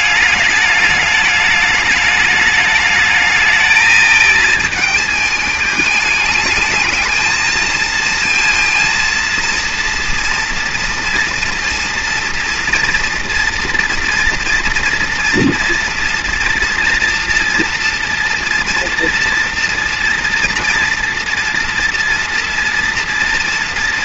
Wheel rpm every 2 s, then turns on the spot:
210, 210, 220, 220, 230, 230, 230, 230, 240, 230, 230, 230.
none